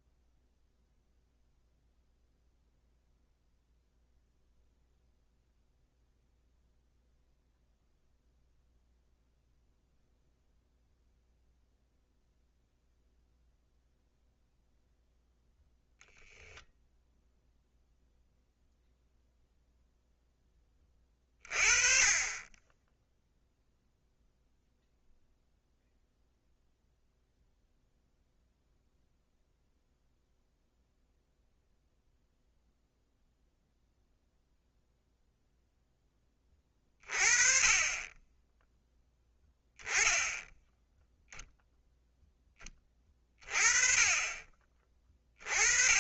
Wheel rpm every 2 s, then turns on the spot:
0, 0, 0, 0, 0, 0, 0, 0, 10, 0, 20, 10, 0, 0, 0, 0, 0, 0, 30, 10, 0, 20, 30.
none